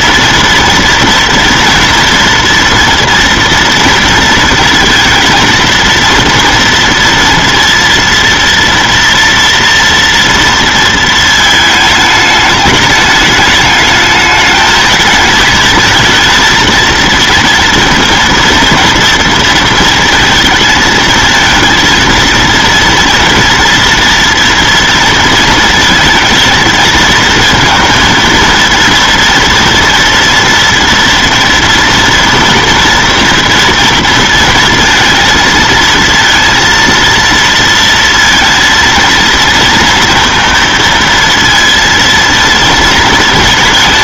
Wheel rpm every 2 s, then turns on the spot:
230, 240, 230, 230, 230, 230, 210, 210, 230, 230, 230, 230, 230, 230, 230, 230, 230, 230, 230, 230, 230, 230.
none